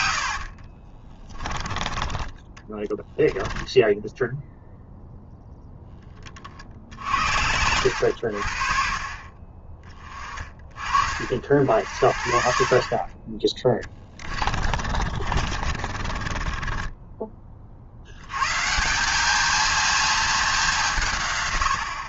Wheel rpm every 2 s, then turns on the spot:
30, 10, 0, 50, 60, 40, 40, 40, 30, 140, 190.
0-4 14-18